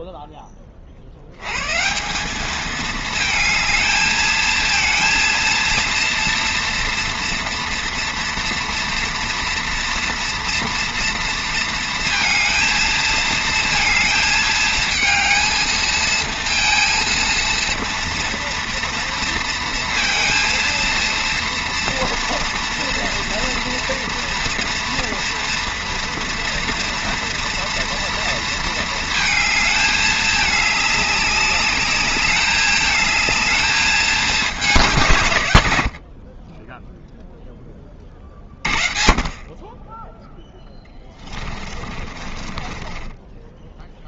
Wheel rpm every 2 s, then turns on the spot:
80, 220, 230, 230, 230, 230, 220, 230, 230, 230, 230, 230, 230, 230, 220, 200, 220, 100, 0, 30, 20, 10.
40-44